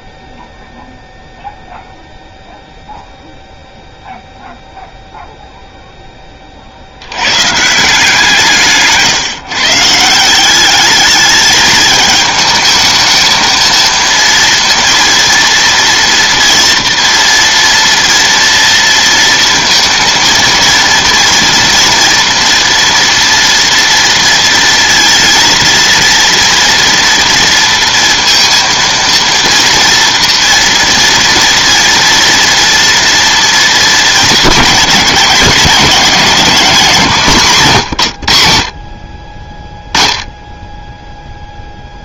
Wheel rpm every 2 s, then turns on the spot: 0, 0, 0, 50, 150, 200, 220, 230, 230, 230, 230, 230, 230, 230, 230, 230, 230, 220, 200, 70, 10.
none